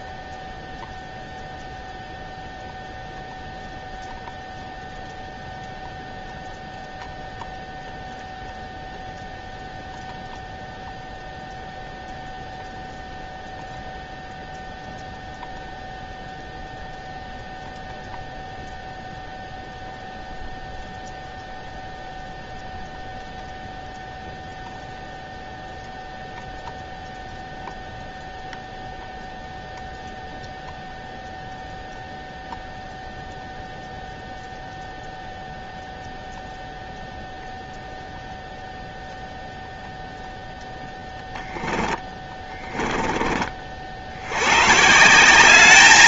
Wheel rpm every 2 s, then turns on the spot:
0, 0, 0, 0, 0, 0, 0, 0, 0, 0, 0, 0, 0, 0, 0, 0, 0, 0, 0, 0, 0, 20, 80.
42-44